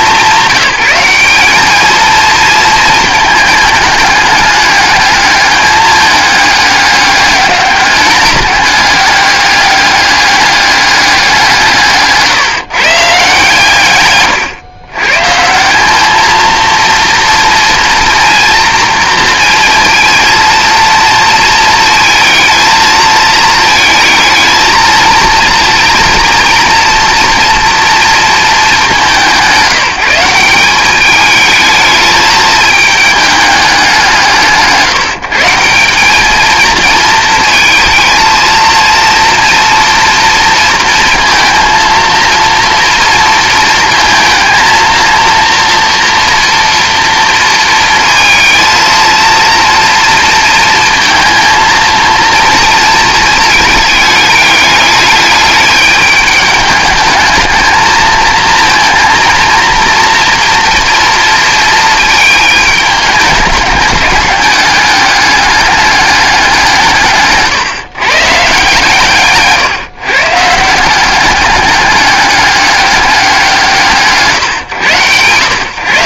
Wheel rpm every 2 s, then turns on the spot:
190, 220, 210, 200, 200, 200, 160, 120, 230, 230, 230, 220, 220, 230, 200, 200, 220, 150, 220, 230, 230, 230, 230, 230, 230, 230, 230, 210, 210, 220, 230, 210, 200, 160, 150, 180, 200, 130.
none